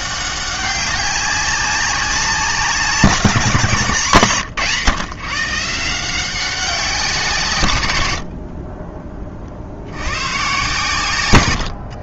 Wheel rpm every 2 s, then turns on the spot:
190, 180, 140, 190, 40, 130.
8-10